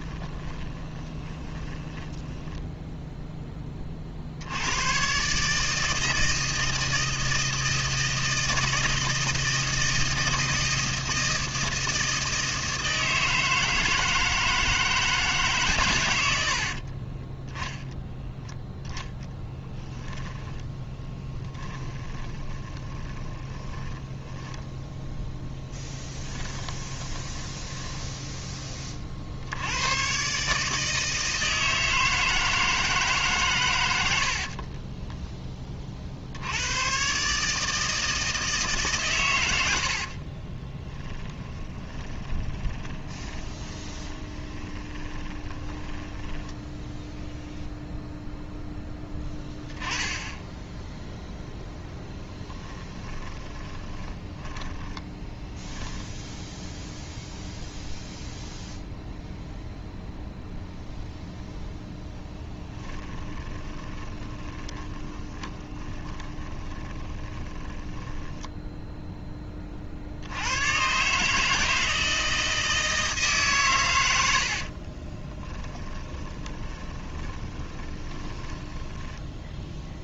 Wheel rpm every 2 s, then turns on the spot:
20, 0, 100, 160, 160, 160, 160, 160, 50, 0, 10, 30, 10, 20, 20, 150, 160, 30, 110, 140, 20, 30, 20, 10, 0, 0, 10, 10, 0, 0, 0, 10, 20, 20, 0, 120, 160, 40, 20, 10.
0-2 16-18 20-28 34-36 40-46 52-56 62-68 74-80